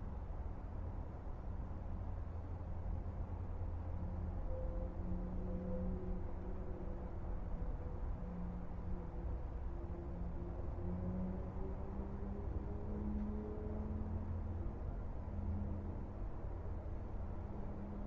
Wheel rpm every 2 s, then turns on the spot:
0, 0, 0, 0, 0, 0, 0, 0, 0.
none